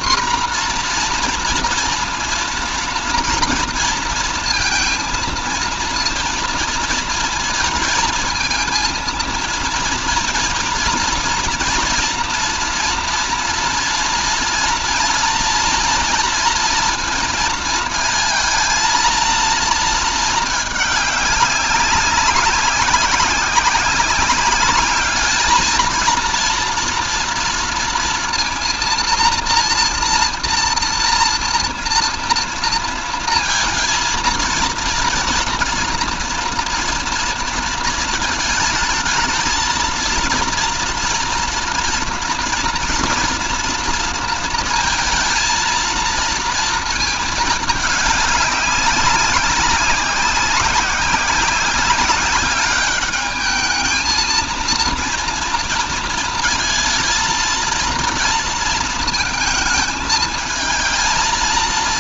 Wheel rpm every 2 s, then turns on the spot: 240, 230, 230, 230, 230, 230, 230, 230, 230, 220, 210, 190, 210, 230, 230, 230, 230, 230, 240, 220, 230, 230, 230, 230, 200, 190, 200, 230, 220, 230, 220.
none